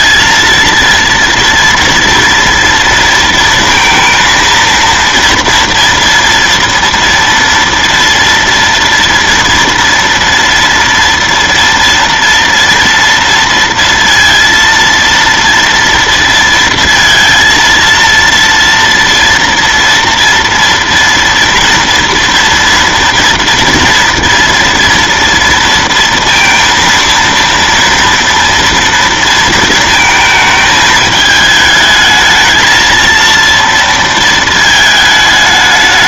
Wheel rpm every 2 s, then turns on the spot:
230, 230, 230, 230, 230, 230, 230, 230, 230, 230, 230, 230, 230, 230, 230, 220, 220, 220.
none